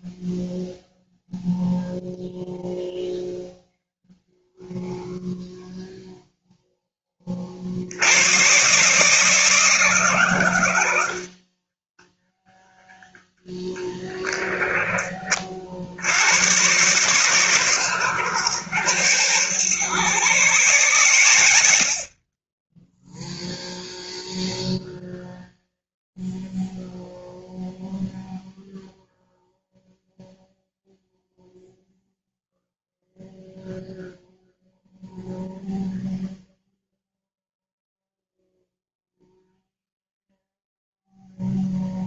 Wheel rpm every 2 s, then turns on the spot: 0, 0, 0, 20, 150, 80, 10, 30, 120, 100, 110, 10, 0, 0, 0, 0, 0, 0, 0, 0, 0.
10-12